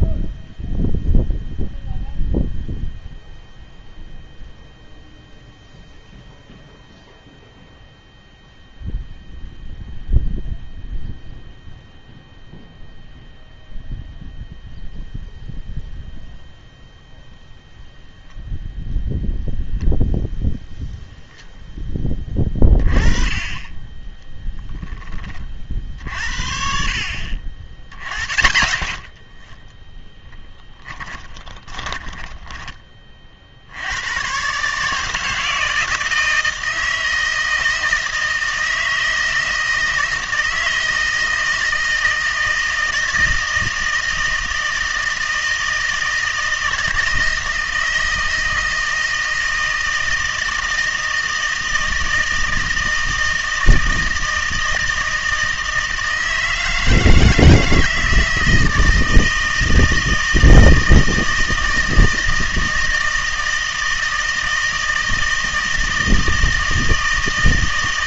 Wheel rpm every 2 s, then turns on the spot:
0, 0, 0, 0, 0, 0, 0, 0, 0, 0, 0, 20, 0, 50, 60, 10, 20, 140, 160, 160, 160, 160, 160, 160, 160, 160, 160, 160, 160, 160, 160, 160, 160, 160.
30-34